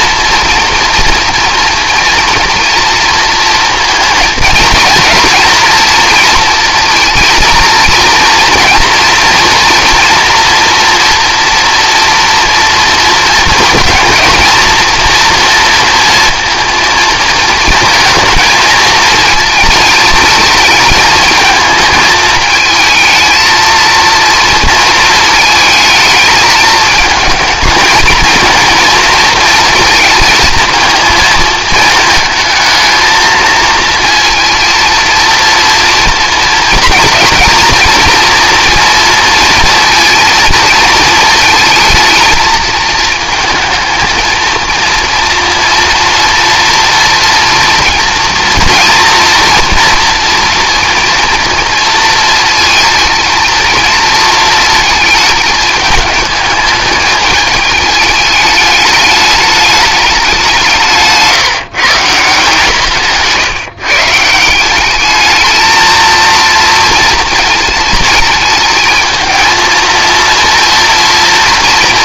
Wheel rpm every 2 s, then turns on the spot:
230, 240, 230, 230, 230, 240, 230, 230, 230, 220, 220, 220, 230, 220, 220, 220, 220, 230, 230, 230, 230, 220, 230, 230, 230, 230, 230, 230, 210, 210, 190, 160, 170, 230, 220, 230.
none